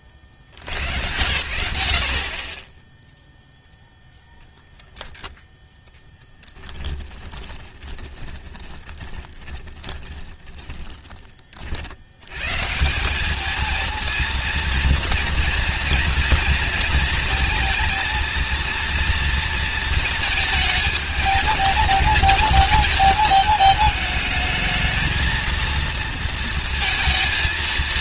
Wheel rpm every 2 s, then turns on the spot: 60, 30, 0, 10, 20, 10, 180, 230, 220, 230, 220, 220, 220, 220.
6-12